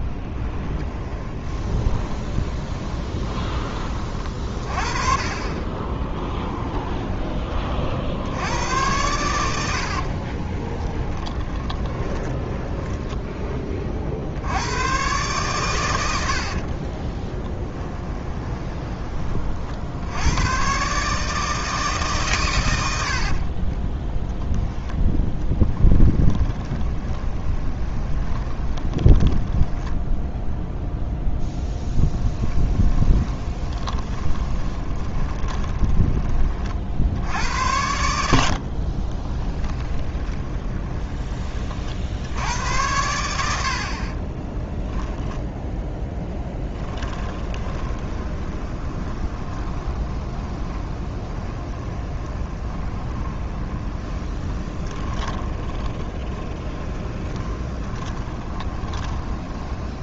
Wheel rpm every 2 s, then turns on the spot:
20, 20, 30, 10, 100, 20, 10, 110, 30, 20, 130, 100, 0, 20, 20, 0, 20, 20, 50, 40, 20, 90, 10, 10, 30, 20, 20, 20, 30, 20.
0-4 10-12 16-20 26-30 32-36 38-40 46-60